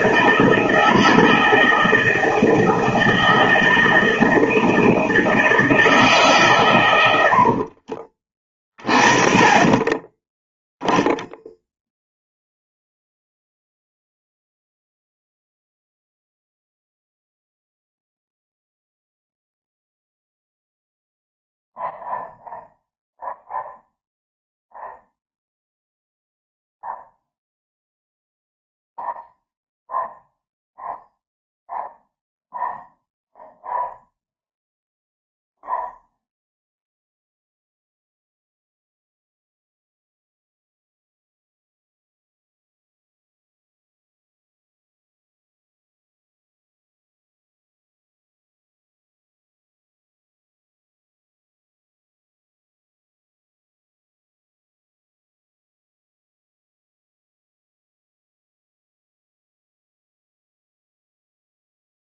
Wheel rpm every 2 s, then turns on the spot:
160, 160, 160, 120, 20, 0, 0, 0, 0, 0, 0, 0, 0, 0, 0, 0, 0, 0, 0, 0, 0, 0, 0, 0, 0, 0, 0, 0, 0, 0, 0.
none